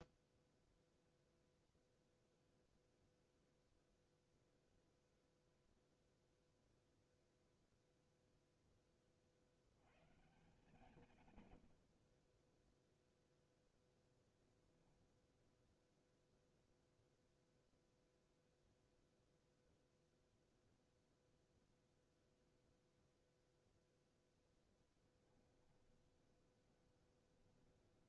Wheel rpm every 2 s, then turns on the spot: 0, 0, 0, 0, 10, 120, 0, 10, 0, 0, 0, 0, 10, 20.
24-28